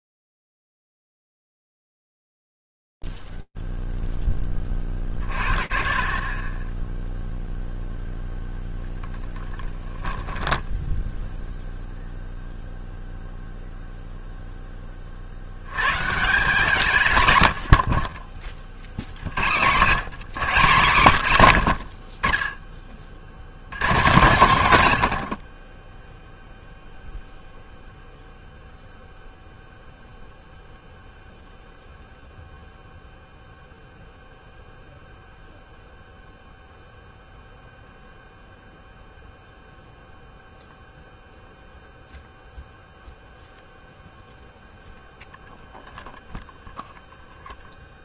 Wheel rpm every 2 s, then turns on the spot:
0, 0, 0, 40, 0, 10, 0, 0, 150, 30, 170, 40, 160, 0, 0, 0, 0, 0, 0, 0, 0, 0, 0, 0.
10-12